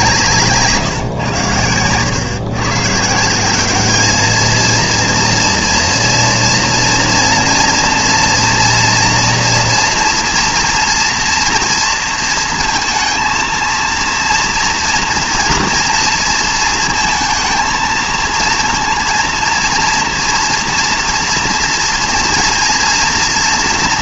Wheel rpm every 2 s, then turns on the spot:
160, 130, 220, 230, 230, 230, 230, 230, 230, 220, 230, 230.
none